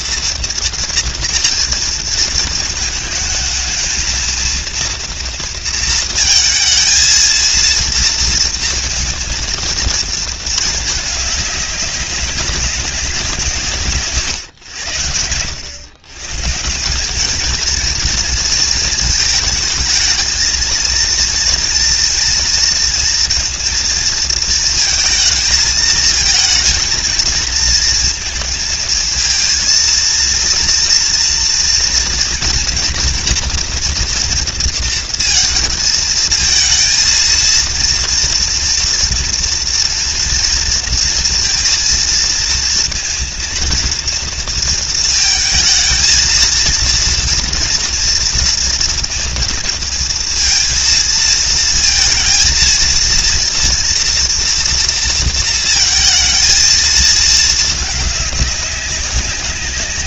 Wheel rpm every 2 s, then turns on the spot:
230, 220, 230, 230, 230, 220, 190, 100, 200, 220, 230, 230, 220, 220, 230, 230, 240, 230, 230, 230, 230, 230, 230, 230, 230, 230, 230, 230, 220, 190.
none